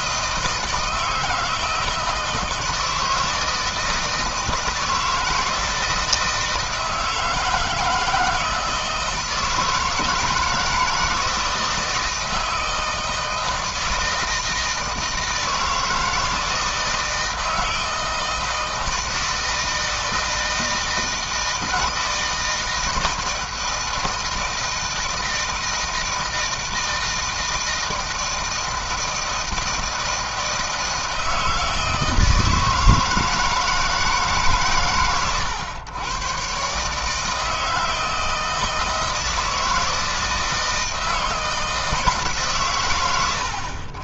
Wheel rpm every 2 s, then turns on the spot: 160, 160, 160, 160, 160, 160, 160, 160, 160, 160, 160, 160, 160, 160, 160, 160, 160, 140, 140, 160, 160, 120.
none